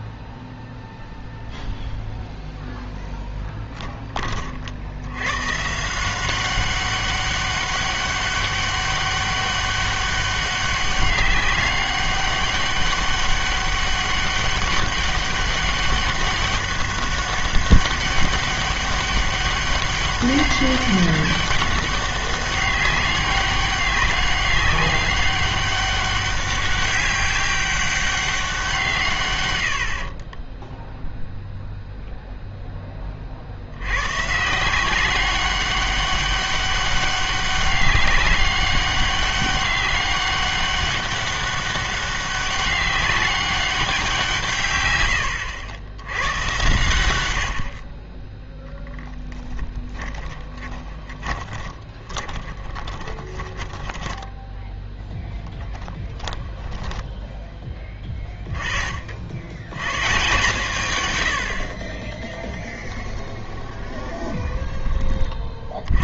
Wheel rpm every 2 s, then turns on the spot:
0, 0, 50, 190, 200, 200, 200, 200, 200, 200, 200, 200, 200, 200, 170, 20, 10, 170, 200, 200, 200, 200, 130, 110, 10, 20, 20, 0, 0, 30, 140, 10, 10.
30-32 50-54 62-66